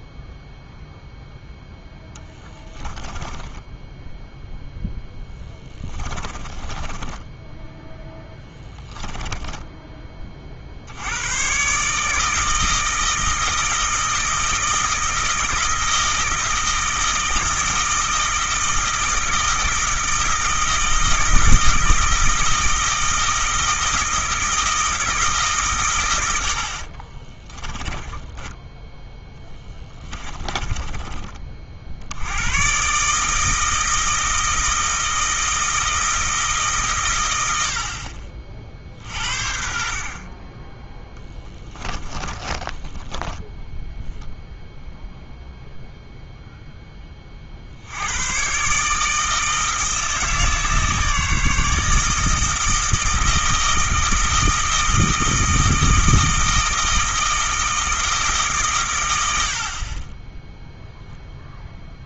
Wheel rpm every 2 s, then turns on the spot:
0, 20, 0, 20, 10, 70, 160, 160, 160, 160, 160, 160, 160, 50, 10, 20, 130, 160, 130, 60, 10, 20, 0, 10, 150, 150, 160, 160, 160, 110, 0.
2-4 6-8 26-28 30-32 42-44